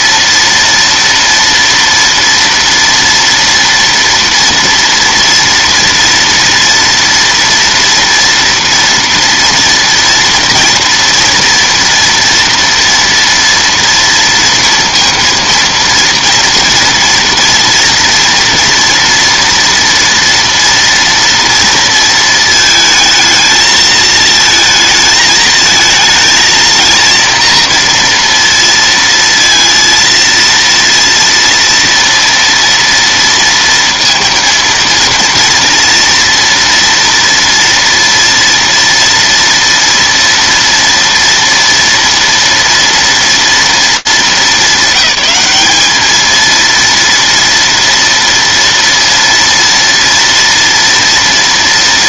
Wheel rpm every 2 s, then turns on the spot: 230, 230, 230, 230, 230, 230, 230, 230, 230, 240, 230, 230, 220, 220, 230, 230, 230, 230, 240, 230, 230, 230, 210, 210, 230, 230.
none